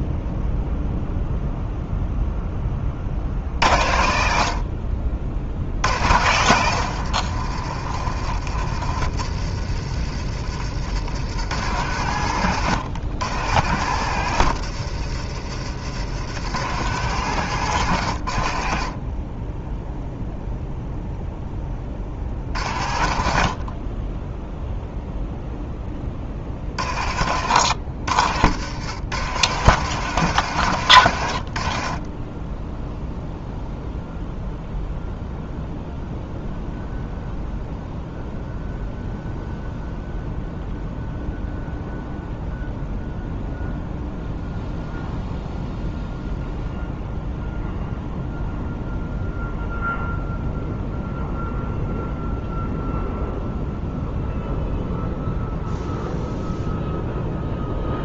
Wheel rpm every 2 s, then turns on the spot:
0, 20, 60, 110, 70, 80, 90, 100, 100, 50, 0, 40, 0, 40, 80, 100, 10, 0, 0, 0, 0, 0, 0, 0, 0, 0, 0, 0, 0.
10-12